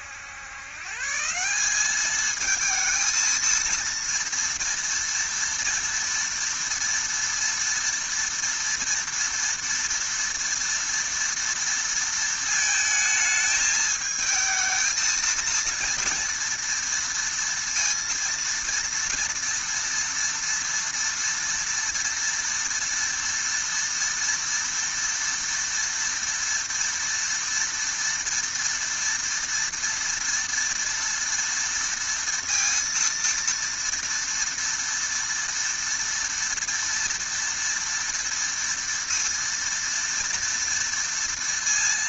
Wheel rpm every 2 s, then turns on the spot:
120, 220, 230, 230, 230, 230, 220, 220, 230, 230, 230, 230, 230, 230, 230, 230, 230, 230, 230, 230, 240.
none